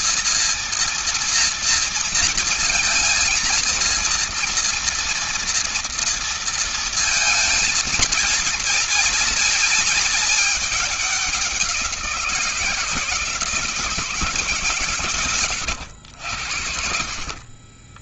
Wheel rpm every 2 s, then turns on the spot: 230, 230, 230, 230, 220, 210, 170, 150, 90.
none